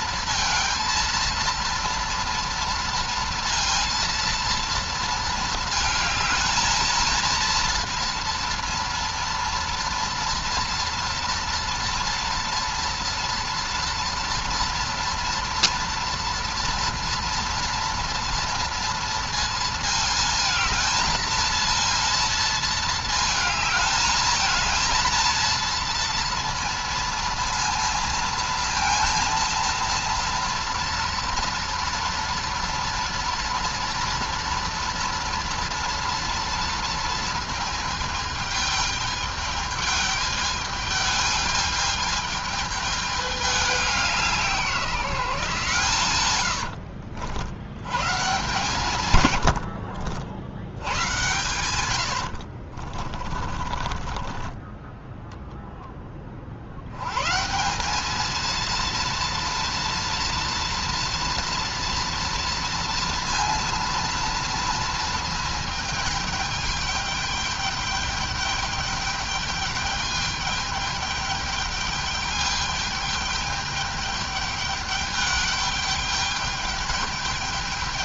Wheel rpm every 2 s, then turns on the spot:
230, 230, 230, 230, 240, 230, 230, 230, 230, 230, 220, 230, 230, 230, 230, 230, 230, 230, 230, 220, 210, 210, 170, 90, 150, 80, 50, 10, 70, 230, 240, 230, 230, 210, 210, 210, 210, 210, 210.
46-48 52-56